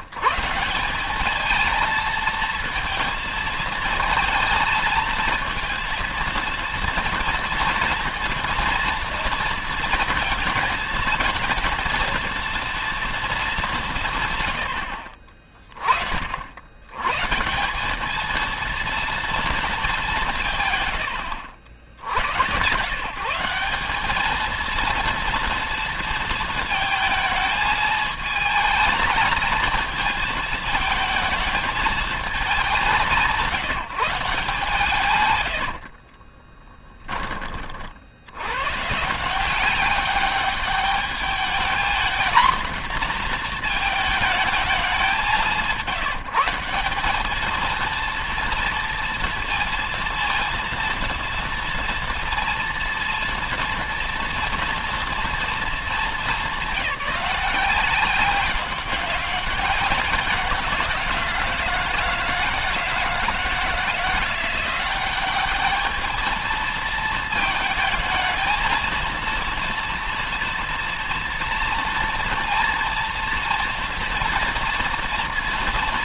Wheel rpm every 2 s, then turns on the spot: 160, 230, 220, 230, 230, 220, 230, 100, 80, 230, 140, 110, 220, 230, 220, 220, 200, 150, 20, 110, 200, 240, 210, 180, 230, 230, 230, 230, 200, 190, 180, 160, 180, 220, 220, 230, 230, 230.
36-38